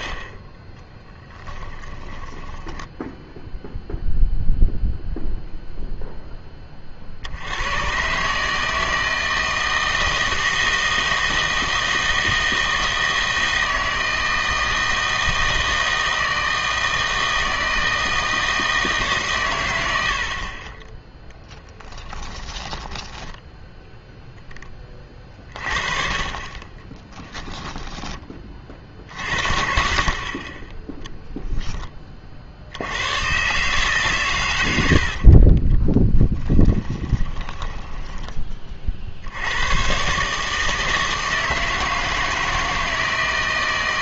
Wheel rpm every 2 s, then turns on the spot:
10, 20, 0, 20, 160, 160, 160, 160, 160, 160, 30, 10, 20, 20, 50, 20, 70, 100, 20, 30, 160, 160.
0-4 22-24 26-28 36-38